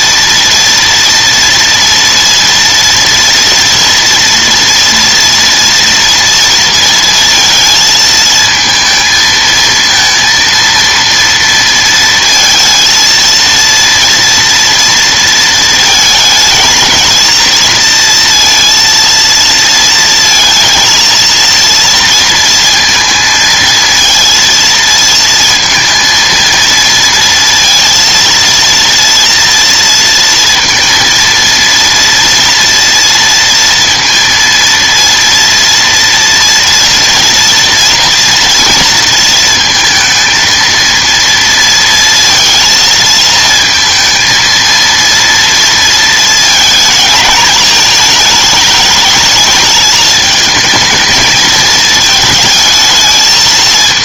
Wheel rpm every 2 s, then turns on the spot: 240, 230, 230, 230, 220, 230, 230, 230, 230, 230, 220, 230, 230, 230, 230, 230, 230, 230, 230, 230, 230, 230, 230, 220, 220, 220, 220.
none